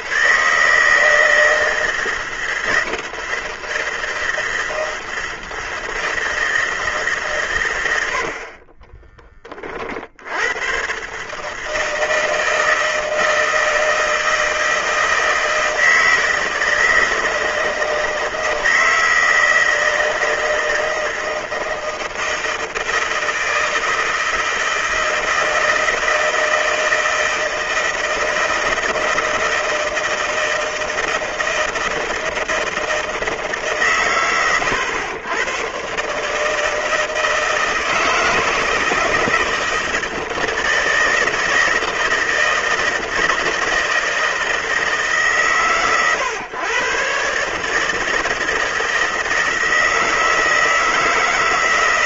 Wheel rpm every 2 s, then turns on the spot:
140, 160, 160, 160, 40, 110, 160, 160, 160, 160, 160, 160, 160, 160, 160, 160, 160, 110, 150, 160, 160, 160, 160, 120, 160, 160.
8-10